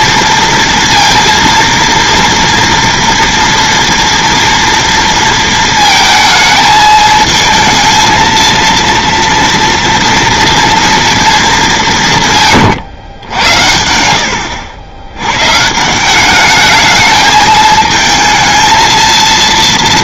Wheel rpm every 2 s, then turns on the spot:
230, 230, 230, 220, 230, 230, 140, 90, 210, 220.
12-14